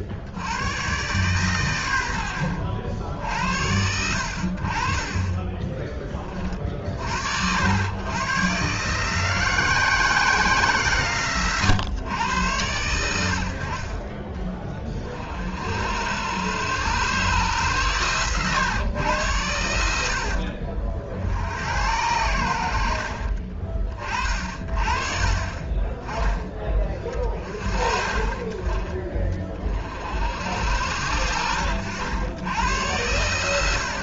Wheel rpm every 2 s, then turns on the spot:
110, 70, 40, 60, 130, 140, 90, 30, 130, 110, 50, 50, 40, 30, 30, 90, 100.
none